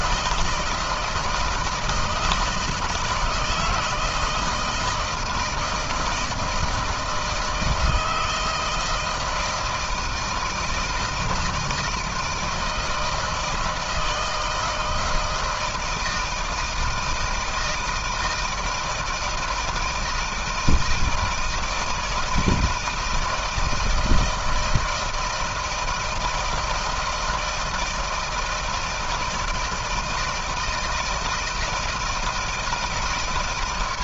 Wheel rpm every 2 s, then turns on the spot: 160, 160, 160, 160, 160, 160, 160, 160, 160, 160, 160, 160, 160, 160, 160, 160, 150.
none